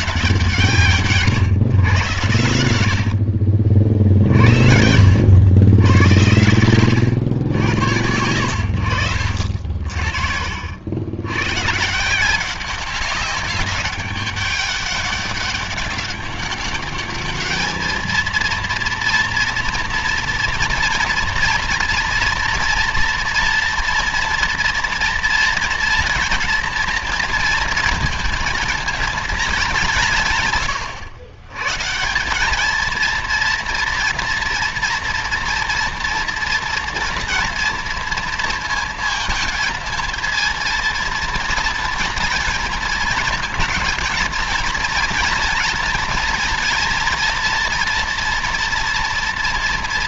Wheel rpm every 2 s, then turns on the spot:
160, 80, 60, 100, 80, 80, 190, 200, 200, 230, 230, 230, 230, 230, 220, 110, 230, 230, 230, 220, 230, 220, 230, 230, 230.
2-4 8-10